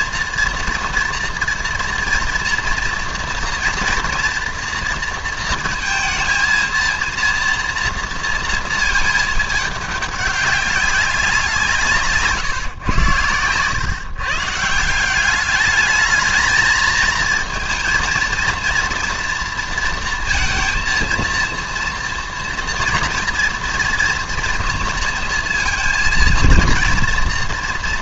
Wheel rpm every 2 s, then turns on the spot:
230, 230, 230, 230, 230, 200, 130, 150, 220, 230, 230, 230, 230, 230.
none